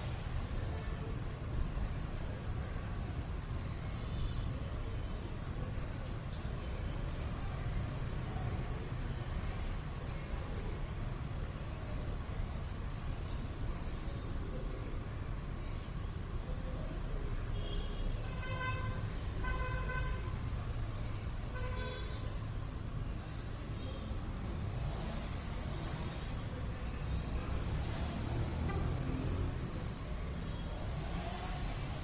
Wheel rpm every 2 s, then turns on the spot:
0, 0, 0, 0, 0, 0, 0, 0, 0, 0, 0, 0, 0, 0, 0, 0.
none